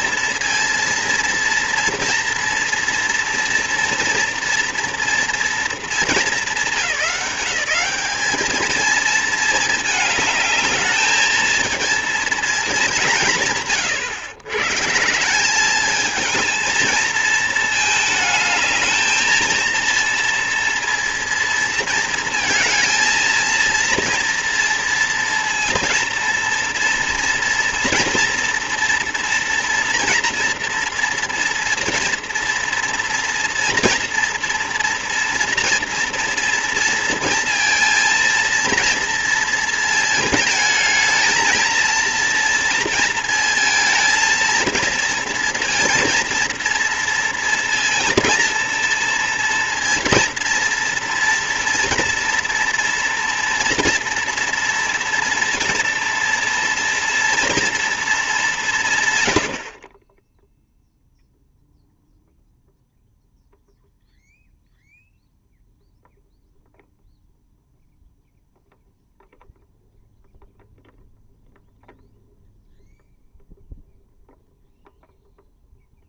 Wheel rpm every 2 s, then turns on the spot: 230, 240, 240, 200, 220, 220, 200, 130, 230, 220, 230, 230, 230, 230, 230, 240, 230, 230, 230, 230, 220, 230, 230, 230, 230, 230, 230, 240, 230, 180, 0, 0, 0, 0, 0, 0, 0, 0.
none